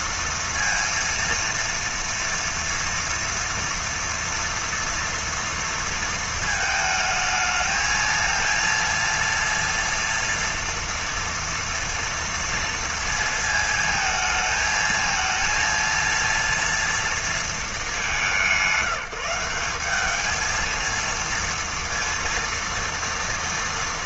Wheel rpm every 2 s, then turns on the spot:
230, 230, 230, 220, 230, 230, 230, 230, 230, 170, 230, 230.
none